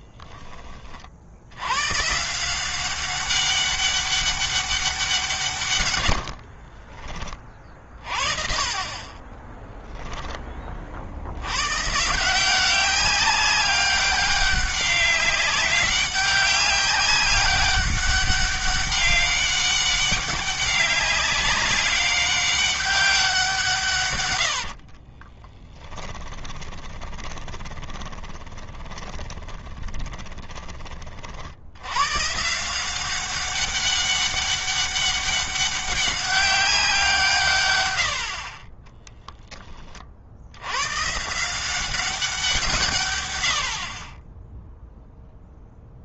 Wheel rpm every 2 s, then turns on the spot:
40, 190, 180, 50, 40, 50, 190, 200, 200, 200, 200, 190, 60, 20, 20, 40, 180, 200, 170, 20, 130, 140, 0.
6-10 24-30 38-40